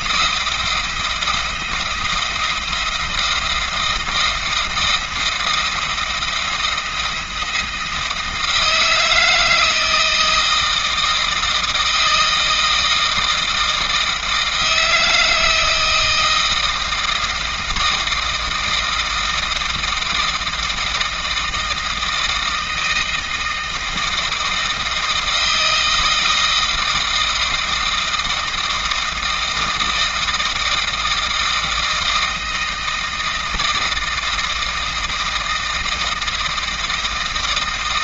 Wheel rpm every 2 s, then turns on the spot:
170, 170, 170, 170, 160, 160, 160, 160, 160, 160, 160, 160, 160, 160, 160, 160, 160, 160, 160.
none